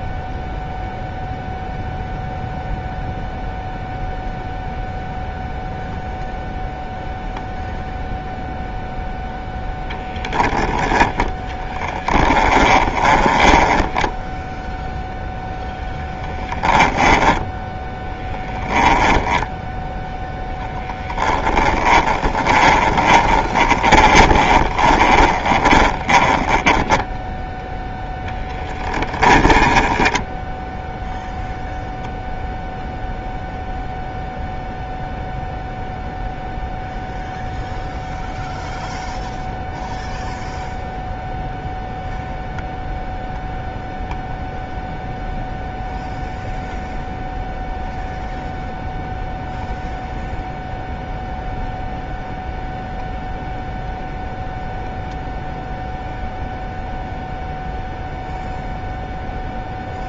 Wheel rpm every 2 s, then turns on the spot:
0, 0, 0, 0, 0, 10, 20, 0, 10, 20, 10, 20, 20, 10, 10, 0, 0, 0, 0, 0, 0, 0, 0, 0, 0, 0, 0, 0, 0, 0.
12-14 16-30